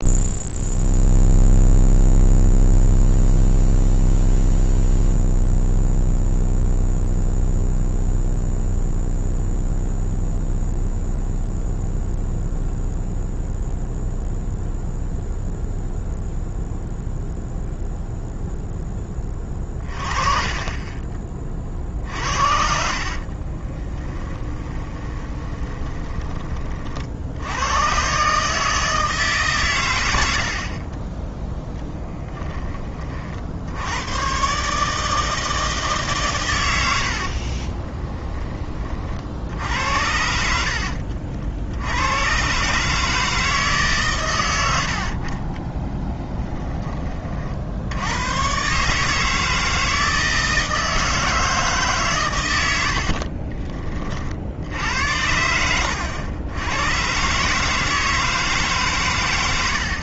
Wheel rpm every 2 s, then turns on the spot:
0, 0, 0, 0, 0, 0, 0, 0, 0, 10, 30, 60, 20, 40, 160, 40, 20, 140, 90, 30, 60, 140, 80, 20, 130, 160, 90, 70, 100, 150.
22-26 44-46 52-54